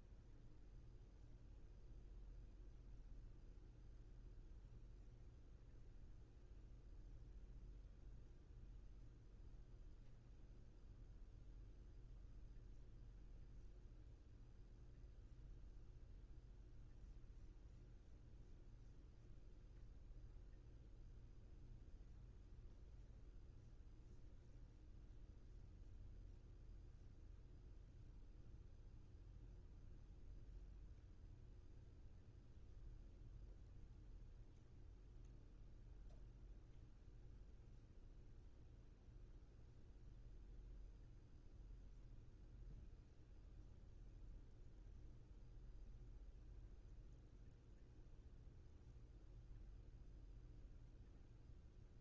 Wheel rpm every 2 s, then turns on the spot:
0, 0, 0, 0, 0, 0, 0, 0, 0, 0, 0, 0, 0, 0, 0, 0, 0, 0, 0, 0, 0, 0, 0, 0, 0, 0.
none